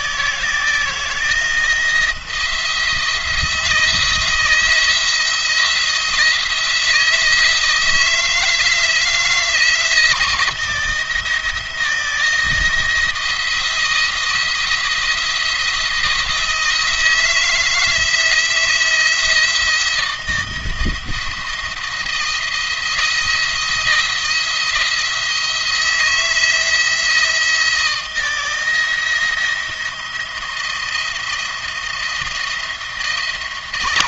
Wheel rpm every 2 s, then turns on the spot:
160, 170, 170, 170, 160, 160, 170, 170, 160, 160, 170, 170, 170, 170, 170, 170, 170.
none